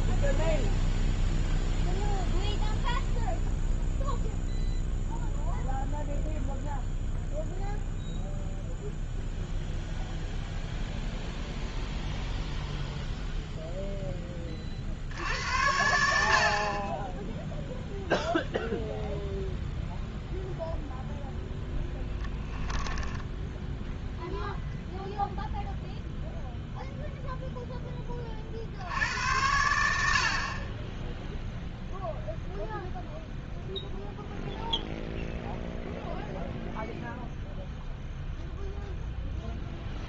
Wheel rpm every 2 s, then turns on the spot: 0, 0, 0, 0, 0, 0, 0, 20, 50, 0, 0, 10, 0, 0, 30, 50, 0, 0, 0, 0.
22-24